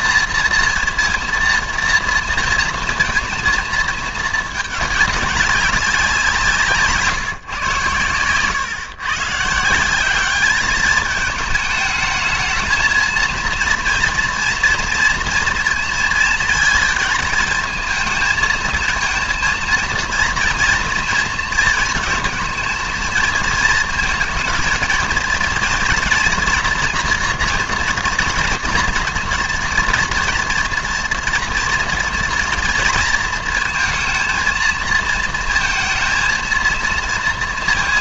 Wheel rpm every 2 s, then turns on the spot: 230, 230, 210, 170, 130, 200, 220, 240, 220, 230, 240, 230, 220, 240, 230, 230, 230, 230, 230.
none